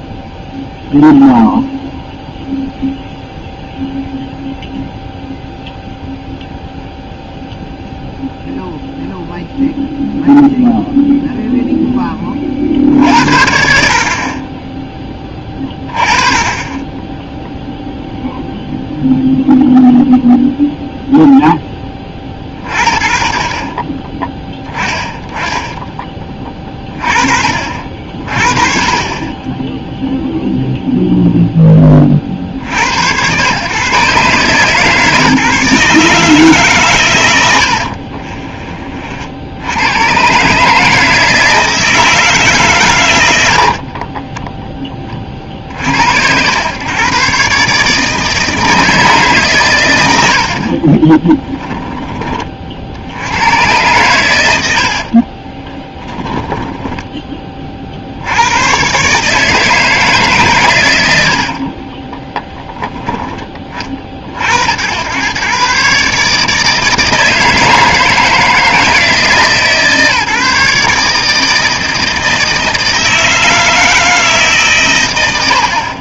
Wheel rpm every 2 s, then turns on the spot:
0, 0, 0, 0, 0, 0, 50, 20, 20, 0, 0, 50, 10, 20, 30, 0, 70, 140, 130, 30, 150, 130, 20, 110, 160, 50, 50, 80, 10, 120, 110, 10, 80, 160, 160, 150, 160, 140.
50-52 56-58